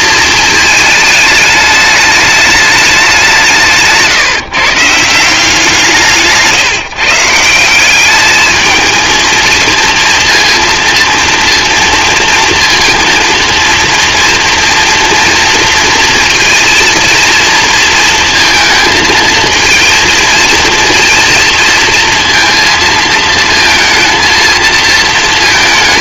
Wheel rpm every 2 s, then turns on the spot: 230, 210, 160, 140, 220, 230, 240, 230, 230, 220, 230, 230, 230.
none